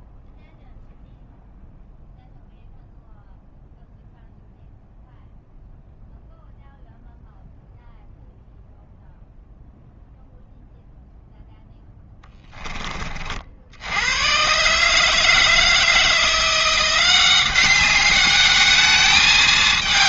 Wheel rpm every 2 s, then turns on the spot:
0, 0, 0, 0, 0, 0, 20, 130, 170, 210.
none